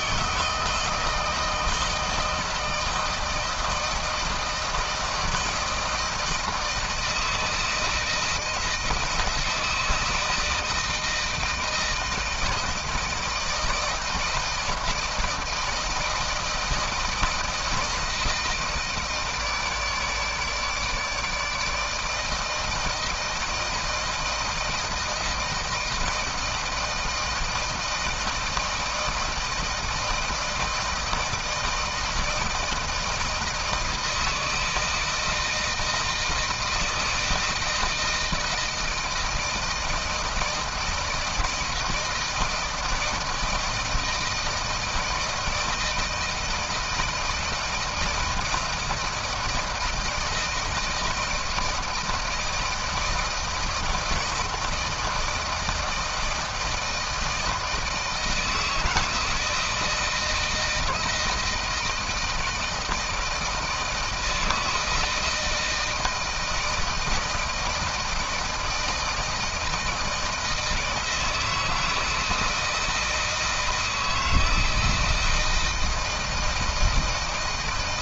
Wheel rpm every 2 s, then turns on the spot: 160, 160, 160, 160, 160, 160, 160, 160, 160, 160, 150, 160, 160, 160, 160, 170, 160, 160, 160, 160, 160, 160, 160, 160, 160, 160, 160, 160, 160, 160, 160, 170, 160, 160, 160, 160, 160, 160, 160.
none